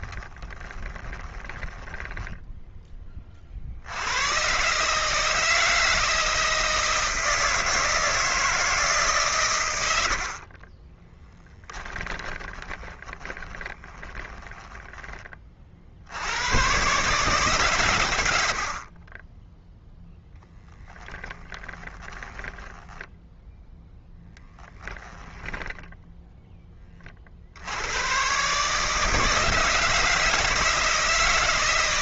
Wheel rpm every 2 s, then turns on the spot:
10, 10, 130, 160, 150, 30, 20, 10, 110, 60, 10, 10, 10, 20, 150, 160.
0-2 12-16 20-26